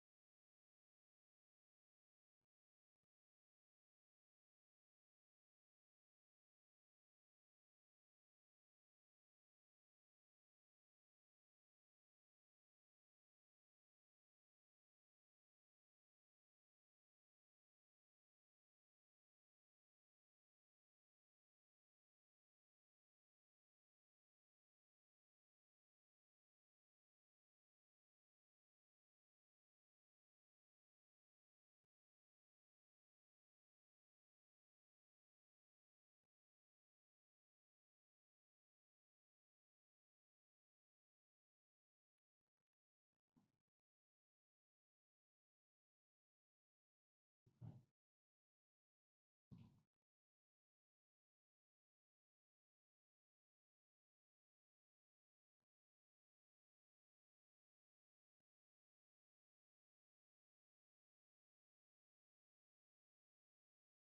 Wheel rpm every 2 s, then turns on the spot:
0, 0, 0, 0, 0, 0, 0, 0, 0, 0, 0, 0, 0, 0, 0, 0, 0, 0, 0, 0, 0, 0, 0, 0, 0, 0, 0, 0, 0, 0, 0, 0.
none